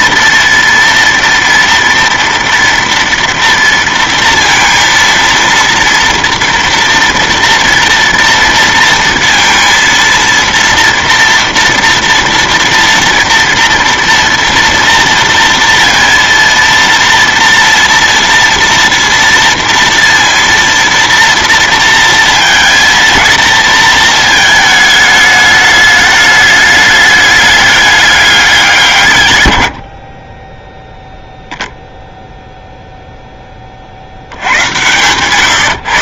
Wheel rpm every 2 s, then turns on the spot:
230, 230, 230, 230, 230, 230, 230, 230, 230, 230, 230, 230, 220, 210, 190, 10, 0, 100.
34-36